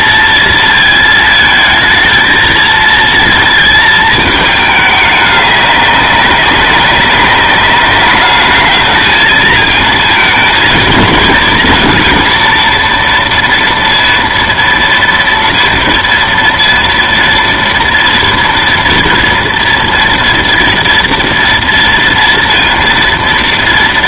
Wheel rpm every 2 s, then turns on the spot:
230, 230, 210, 190, 210, 230, 230, 230, 230, 230, 230, 230.
none